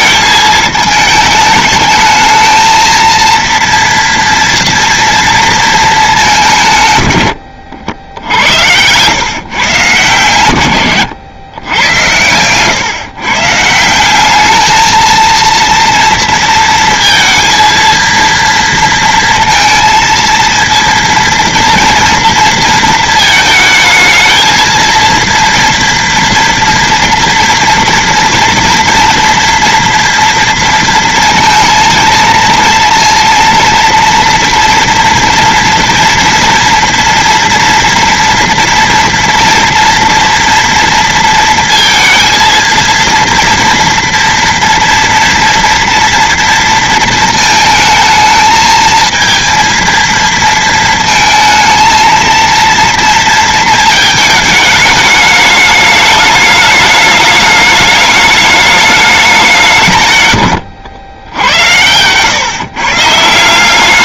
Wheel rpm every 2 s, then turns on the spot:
220, 220, 230, 140, 90, 110, 120, 210, 230, 230, 230, 230, 220, 230, 230, 230, 230, 230, 230, 230, 230, 230, 230, 230, 220, 230, 230, 210, 210, 210, 80, 140.
none